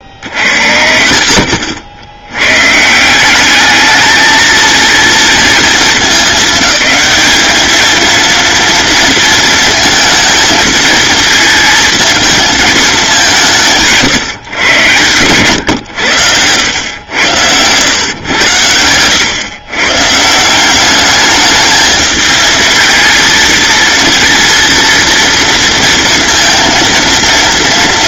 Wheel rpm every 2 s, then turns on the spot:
70, 130, 220, 210, 230, 230, 220, 120, 100, 110, 180, 220, 230, 230.
18-20